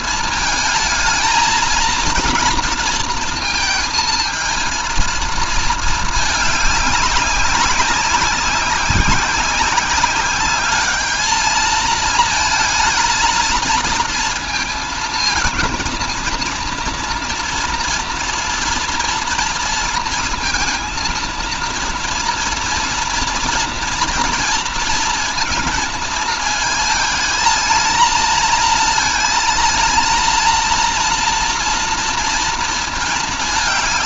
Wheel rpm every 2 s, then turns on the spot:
220, 230, 230, 200, 190, 210, 230, 230, 230, 230, 230, 230, 230, 220, 230, 230, 220.
none